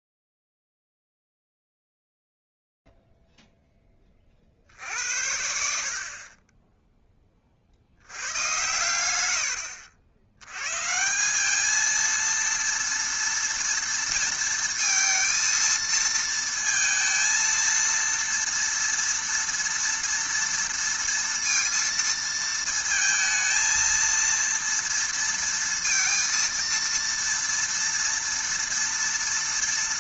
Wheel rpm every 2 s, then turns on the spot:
0, 0, 30, 40, 100, 100, 230, 230, 230, 230, 230, 230, 230, 230, 230.
none